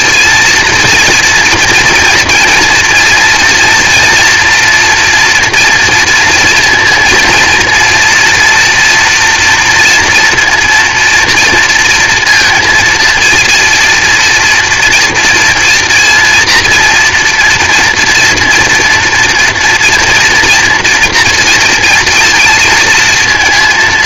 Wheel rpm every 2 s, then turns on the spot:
230, 230, 230, 230, 230, 230, 230, 230, 240, 230, 230, 230.
none